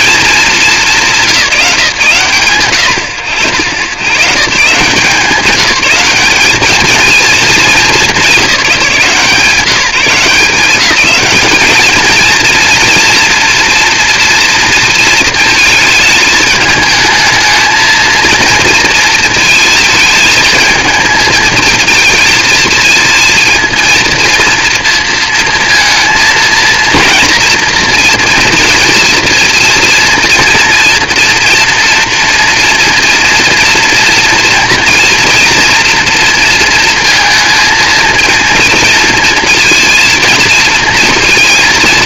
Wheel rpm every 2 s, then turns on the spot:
220, 120, 150, 210, 180, 180, 230, 230, 220, 230, 220, 220, 230, 230, 230, 230, 230, 230, 230, 230, 230.
none